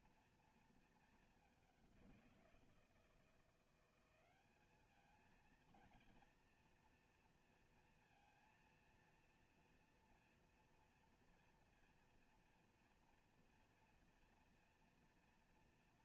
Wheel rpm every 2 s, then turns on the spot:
210, 170, 220, 230, 230, 230, 230, 240.
none